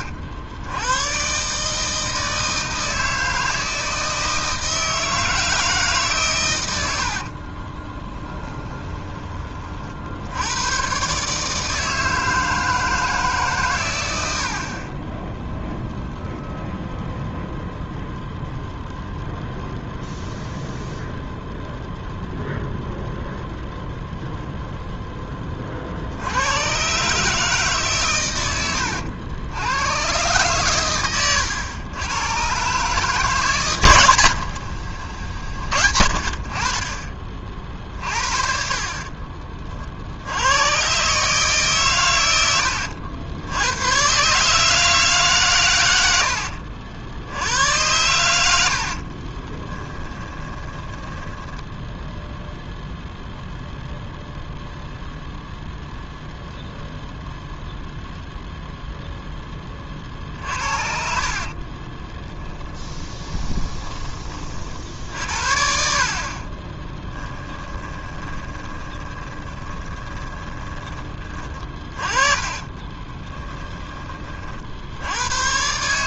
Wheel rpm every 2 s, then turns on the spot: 110, 160, 160, 80, 20, 130, 160, 30, 0, 0, 0, 0, 0, 130, 90, 110, 150, 60, 30, 40, 130, 90, 150, 70, 60, 20, 0, 0, 0, 0, 50, 10, 60, 20, 20, 20, 20, 80.
8-10 34-36 38-40 48-52 60-64 66-70 72-74